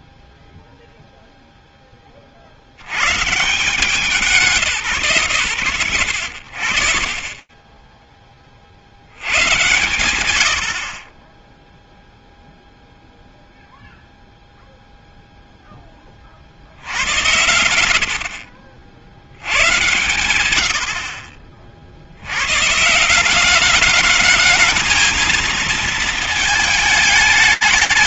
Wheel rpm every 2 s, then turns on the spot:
0, 130, 110, 40, 90, 20, 0, 0, 80, 90, 70, 180, 220, 200.
none